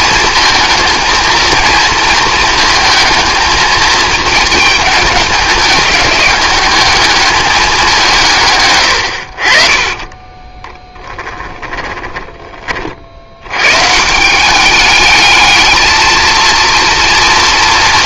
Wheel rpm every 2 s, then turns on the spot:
220, 220, 210, 210, 110, 20, 30, 200, 230.
10-12